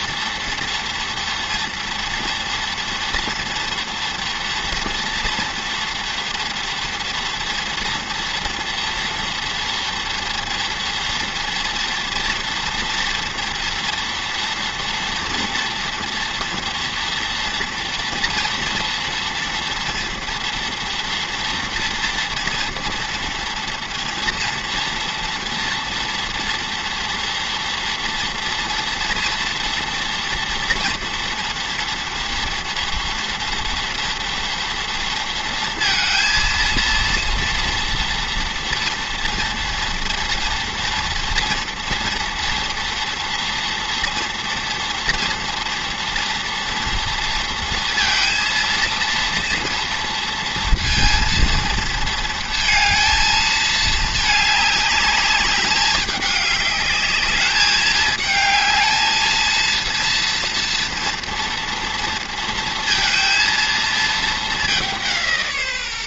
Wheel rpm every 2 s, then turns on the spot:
230, 230, 240, 230, 230, 230, 230, 230, 230, 230, 230, 230, 230, 230, 240, 230, 230, 240, 230, 230, 230, 230, 230, 230, 230, 230, 230, 210, 210, 220, 230, 230, 200.
none